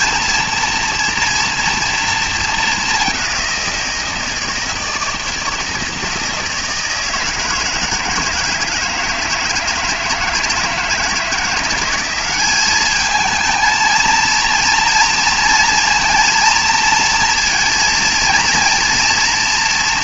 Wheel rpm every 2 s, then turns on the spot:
230, 210, 160, 160, 160, 160, 200, 230, 230, 230.
none